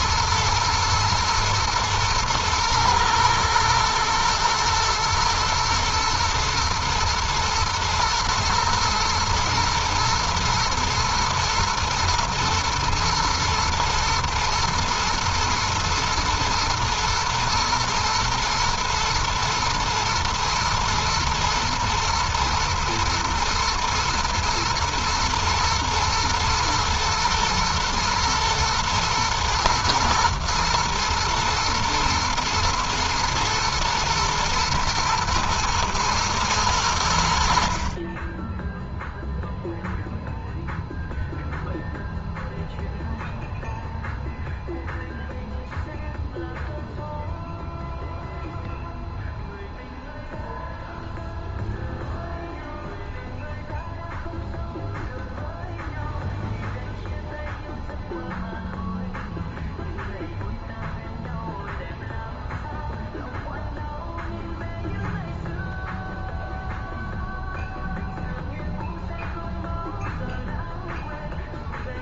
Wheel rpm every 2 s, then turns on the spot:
110, 110, 110, 110, 110, 110, 110, 110, 120, 110, 120, 110, 120, 110, 110, 120, 120, 120, 100, 10, 0, 0, 0, 0, 0, 0, 0, 0, 0, 0, 0, 0, 0, 0, 0, 0.
none